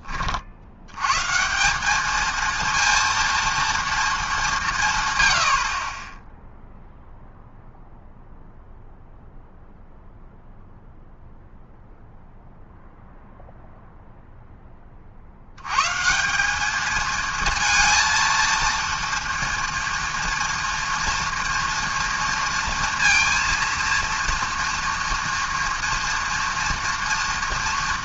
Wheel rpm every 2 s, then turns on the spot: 70, 230, 180, 0, 0, 0, 0, 10, 200, 230, 230, 230, 230, 230.
none